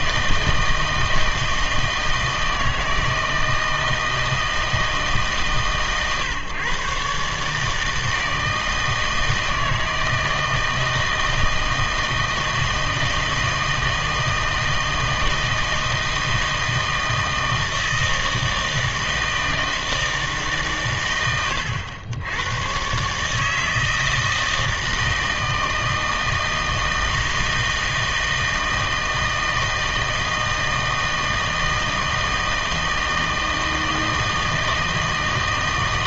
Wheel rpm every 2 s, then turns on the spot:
160, 160, 160, 140, 160, 160, 160, 160, 160, 160, 140, 110, 160, 160, 160, 160, 160, 160.
none